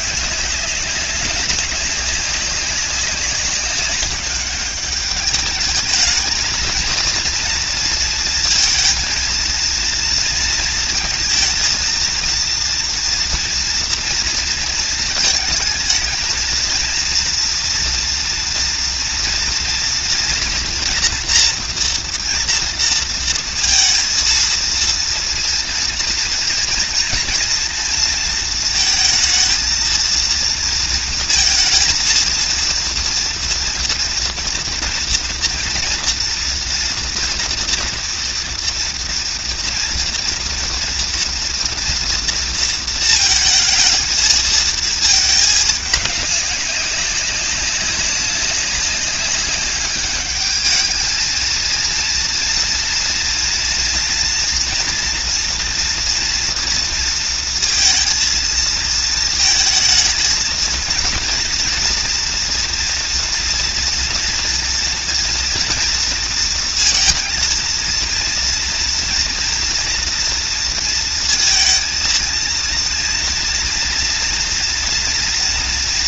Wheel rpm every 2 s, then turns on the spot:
200, 190, 200, 230, 230, 230, 230, 230, 230, 230, 230, 230, 230, 230, 220, 230, 230, 230, 230, 230, 230, 230, 220, 200, 200, 210, 230, 230, 240, 230, 230, 230, 230, 230, 230, 230, 230, 240.
none